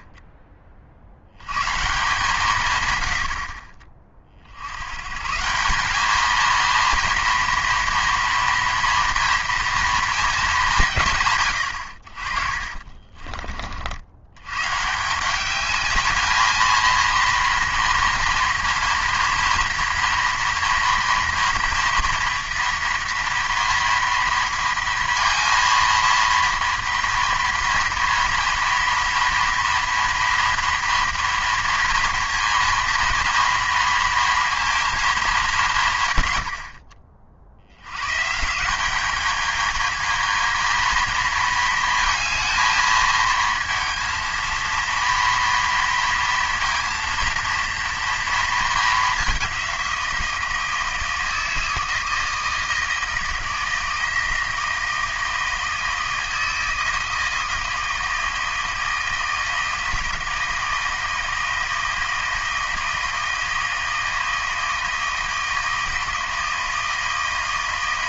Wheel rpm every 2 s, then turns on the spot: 40, 130, 80, 230, 230, 190, 40, 130, 230, 230, 230, 230, 230, 230, 240, 230, 230, 220, 40, 170, 220, 220, 230, 230, 220, 170, 160, 160, 160, 160, 160, 160, 160, 160.
12-14